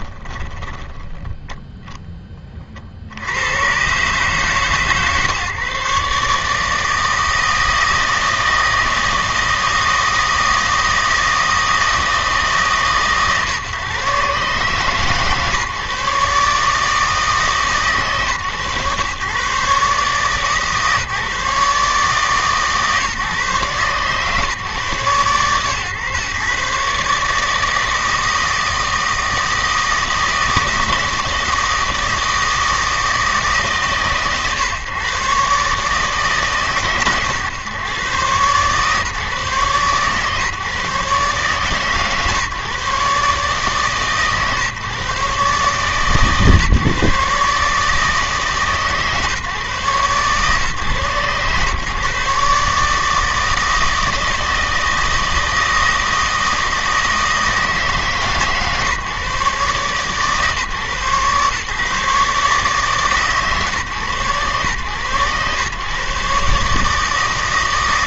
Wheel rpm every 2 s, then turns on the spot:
10, 50, 140, 150, 160, 160, 150, 140, 150, 130, 140, 140, 130, 140, 160, 160, 160, 130, 140, 130, 130, 140, 140, 140, 140, 130, 150, 160, 160, 140, 140, 150, 120, 150.
0-2